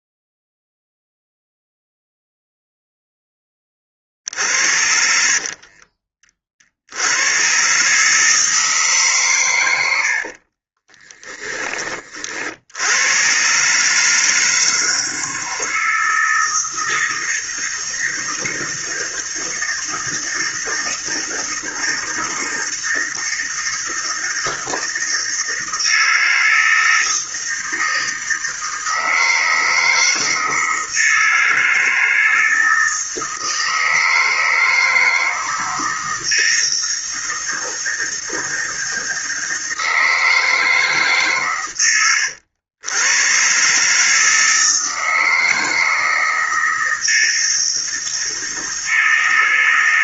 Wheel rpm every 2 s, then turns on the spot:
0, 0, 60, 50, 150, 40, 70, 160, 160, 160, 160, 160, 160, 160, 160, 160, 160, 160, 160, 160, 160, 100, 160, 160, 160.
4-6 10-12